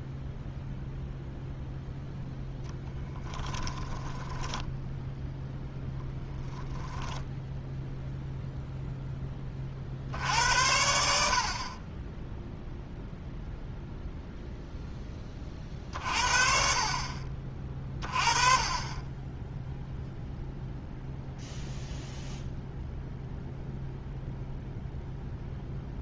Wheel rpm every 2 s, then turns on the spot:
0, 10, 10, 10, 0, 80, 0, 0, 40, 30, 0, 0, 0.
2-8